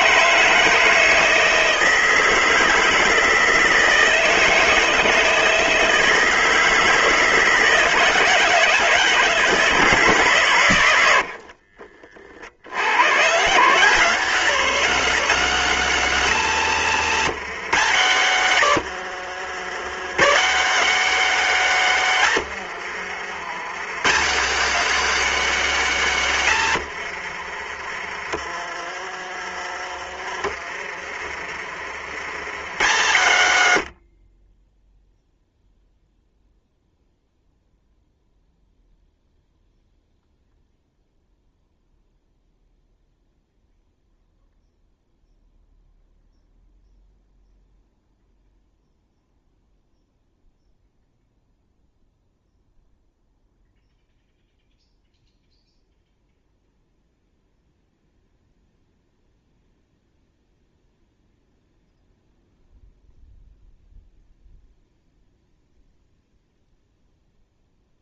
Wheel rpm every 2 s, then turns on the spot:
160, 160, 160, 160, 160, 100, 90, 190, 170, 110, 180, 90, 200, 90, 50, 50, 120, 0, 0, 0, 0, 0, 0, 0, 0, 0, 0, 0, 0, 0, 0, 0, 0, 0.
16-20 22-24 26-32